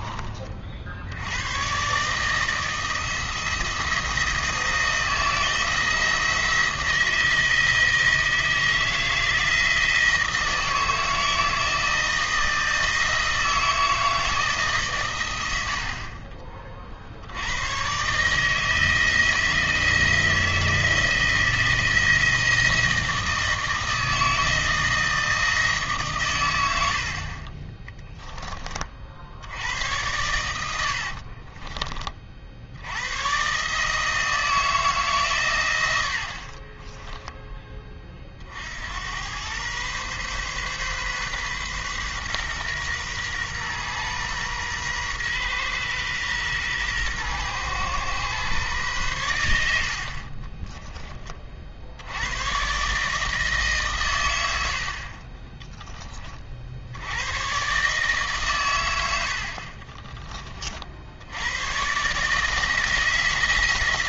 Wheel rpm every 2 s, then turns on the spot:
60, 160, 160, 160, 160, 160, 160, 140, 40, 160, 160, 160, 160, 80, 30, 80, 80, 160, 30, 80, 130, 120, 120, 120, 120, 30, 130, 50, 60, 110, 60, 160.
26-28 36-38 50-52